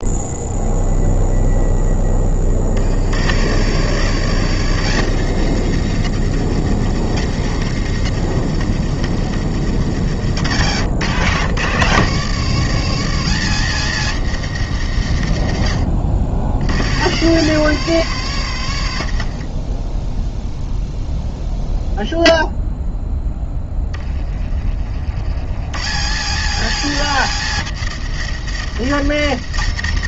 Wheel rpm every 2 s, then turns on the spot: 0, 30, 100, 100, 90, 100, 90, 110, 50, 50, 0, 0, 20, 100, 90.
none